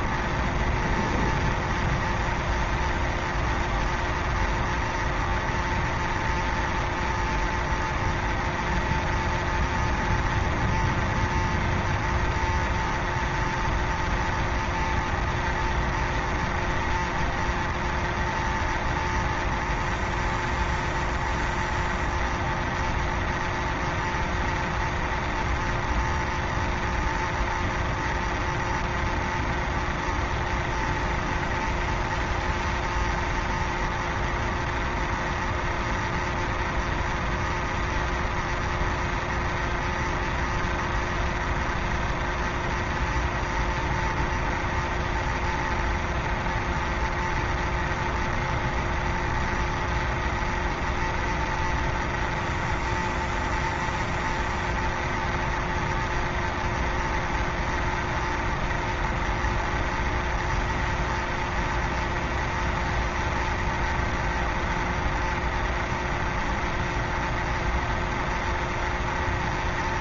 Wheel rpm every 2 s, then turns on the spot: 0, 0, 0, 0, 0, 0, 0, 0, 0, 0, 0, 0, 0, 0, 0, 0, 0, 0, 0, 0, 0, 0, 0, 0, 0, 0, 0, 0, 0, 0, 0, 0, 0, 0, 0.
none